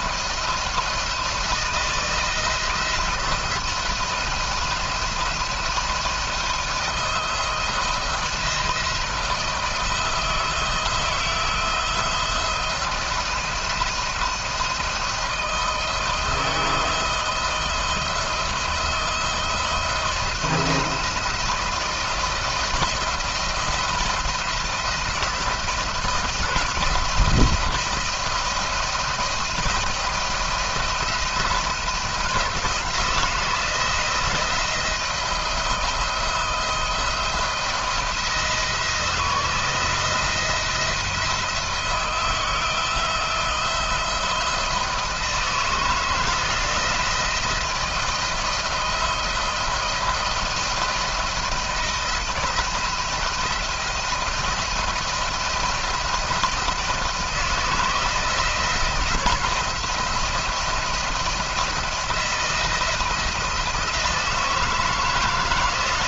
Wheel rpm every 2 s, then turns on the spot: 170, 160, 170, 170, 160, 160, 170, 170, 160, 160, 170, 160, 170, 170, 170, 170, 170, 160, 160, 170, 170, 160, 170, 160, 170, 170, 170, 170, 170, 160, 170, 170, 170.
none